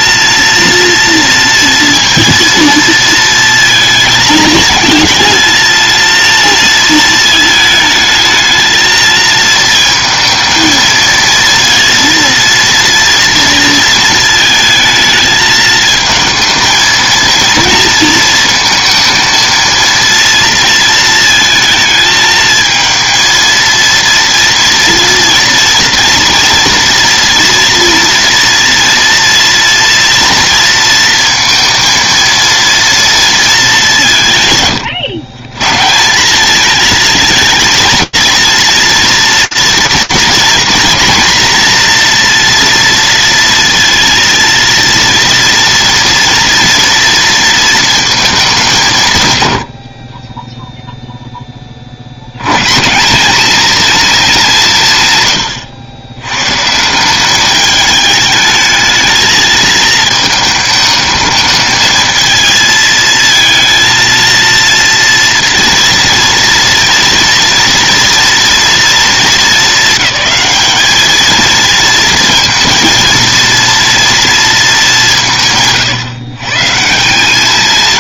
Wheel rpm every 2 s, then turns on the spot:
230, 230, 220, 220, 220, 230, 230, 220, 230, 230, 220, 220, 230, 230, 230, 230, 230, 130, 220, 230, 230, 230, 230, 230, 120, 0, 180, 140, 180, 220, 220, 230, 230, 230, 230, 220, 230, 180, 160.
none